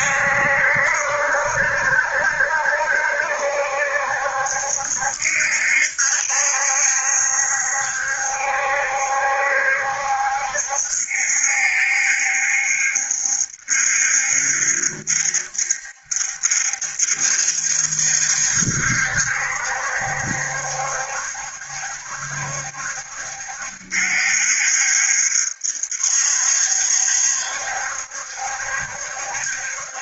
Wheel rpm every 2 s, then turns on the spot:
70, 70, 70, 70, 70, 70, 70, 70, 70, 70, 70, 70, 70, 70, 70.
none